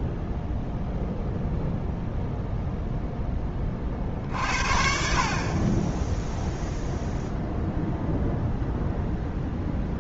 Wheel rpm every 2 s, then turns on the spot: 0, 0, 50, 0, 0.
none